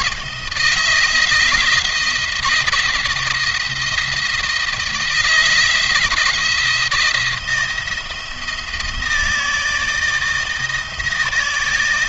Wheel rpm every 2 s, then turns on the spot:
170, 170, 160, 170, 160, 160.
none